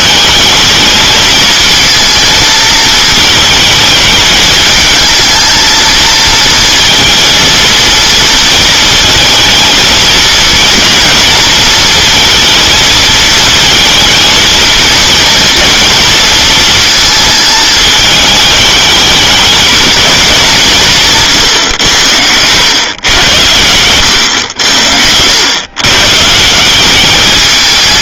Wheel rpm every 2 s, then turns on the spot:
220, 220, 220, 230, 220, 230, 220, 230, 230, 220, 160, 110, 90, 200.
24-26